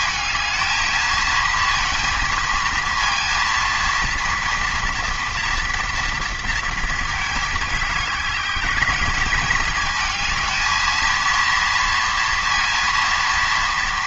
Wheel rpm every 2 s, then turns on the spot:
220, 230, 230, 230, 210, 220, 230.
none